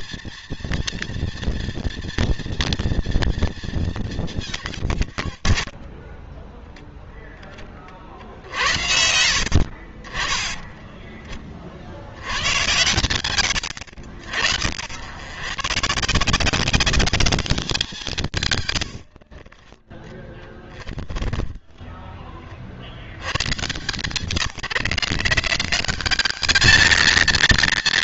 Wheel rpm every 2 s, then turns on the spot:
230, 230, 140, 0, 60, 10, 100, 80, 180, 110, 20, 30, 150, 200.
10-12 20-22